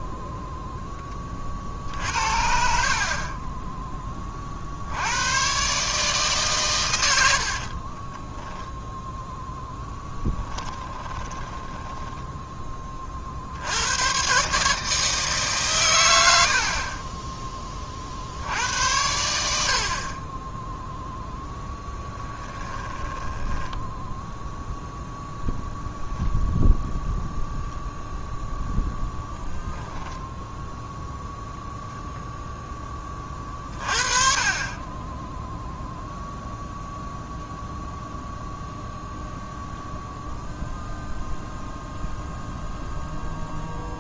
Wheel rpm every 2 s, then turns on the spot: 0, 50, 60, 120, 0, 10, 20, 150, 60, 80, 10, 10, 0, 0, 0, 0, 10, 40, 0, 0, 0, 0.
10-12 16-18 22-24